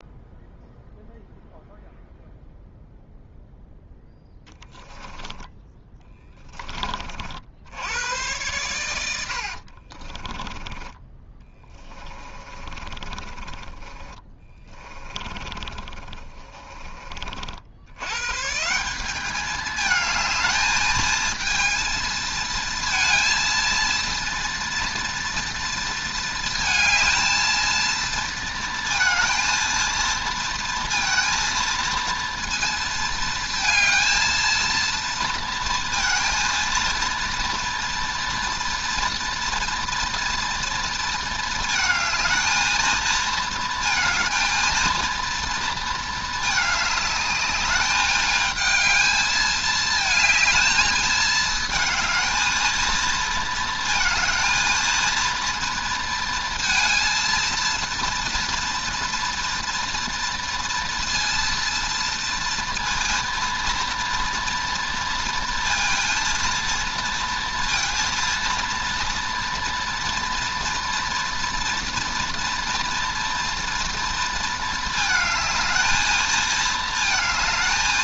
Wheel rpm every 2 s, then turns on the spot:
0, 0, 0, 50, 80, 10, 30, 30, 50, 200, 220, 230, 240, 220, 230, 230, 230, 230, 230, 230, 230, 230, 230, 210, 220, 220, 230, 230, 230, 230, 230, 230, 230, 230, 230, 230, 230, 220, 220.
8-16